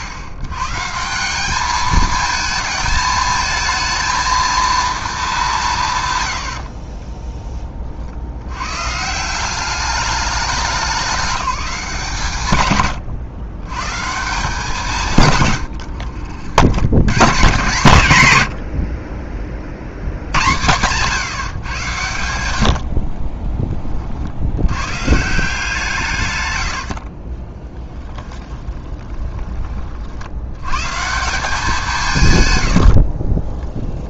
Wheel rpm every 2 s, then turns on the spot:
120, 220, 230, 50, 120, 200, 130, 180, 90, 90, 110, 80, 100, 100, 20, 110, 100.
6-8 26-30 32-34